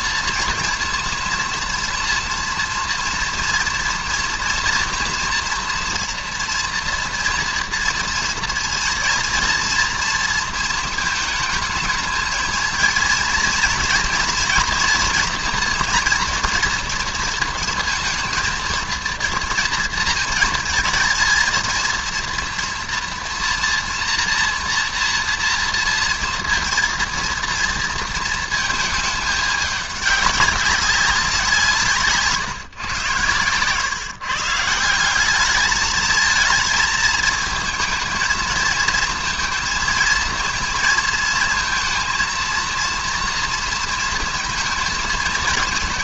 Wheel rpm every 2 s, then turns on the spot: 240, 230, 230, 230, 230, 230, 230, 230, 230, 230, 230, 230, 240, 230, 220, 200, 140, 150, 220, 220, 220, 230, 230.
none